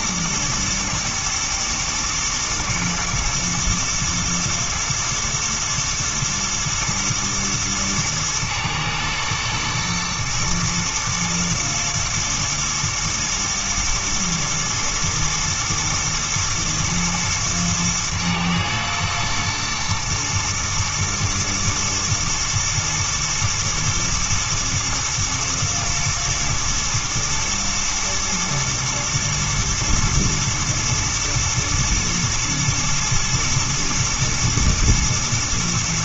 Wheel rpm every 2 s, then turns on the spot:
120, 120, 110, 110, 120, 120, 110, 110, 110, 110, 110, 110, 120, 120, 110, 110, 120, 110.
none